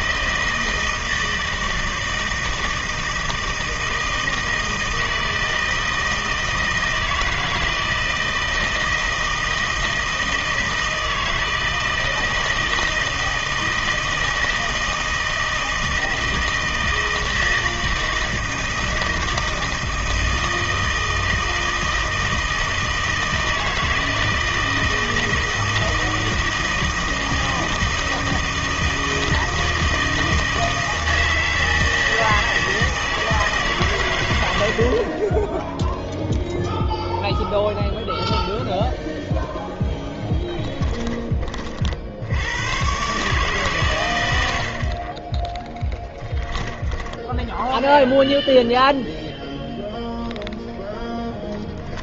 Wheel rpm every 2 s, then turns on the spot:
160, 160, 160, 160, 160, 160, 160, 160, 160, 160, 160, 160, 160, 160, 160, 160, 160, 60, 0, 0, 10, 90, 60, 20, 0, 0.
34-36 40-42 46-48